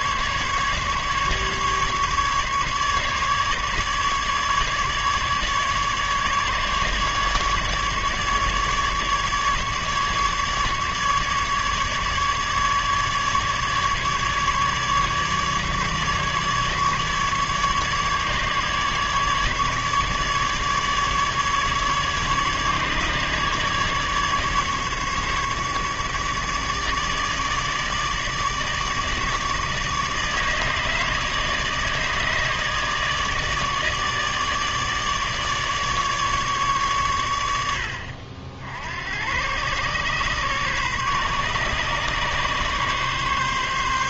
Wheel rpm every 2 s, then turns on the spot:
140, 150, 150, 140, 150, 150, 150, 150, 150, 150, 150, 150, 150, 150, 150, 150, 150, 150, 140, 60, 130, 140.
none